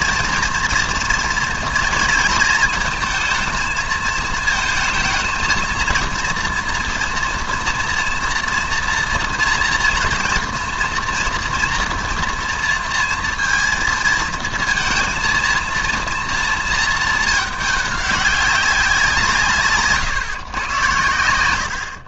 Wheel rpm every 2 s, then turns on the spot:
230, 220, 220, 230, 230, 240, 230, 230, 230, 190, 120.
none